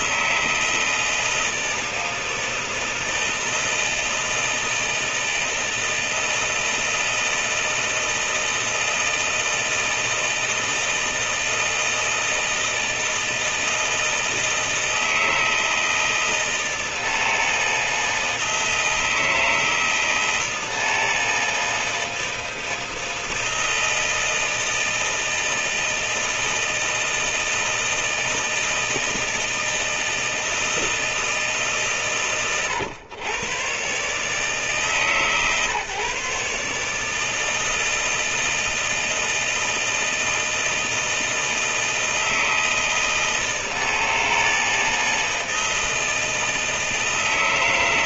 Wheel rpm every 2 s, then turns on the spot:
160, 160, 160, 160, 160, 160, 160, 160, 160, 160, 160, 160, 160, 160, 160, 160, 130, 150, 150, 160, 160, 160, 160, 160.
none